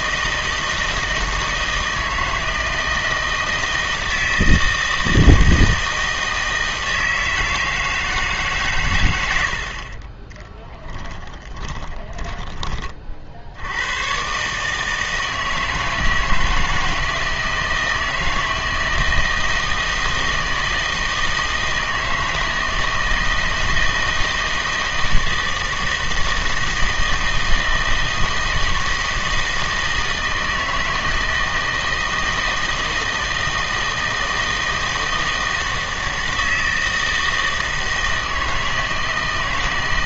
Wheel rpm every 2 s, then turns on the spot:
160, 160, 160, 160, 140, 10, 20, 150, 160, 160, 160, 160, 160, 160, 160, 160, 160, 160, 160, 160.
10-12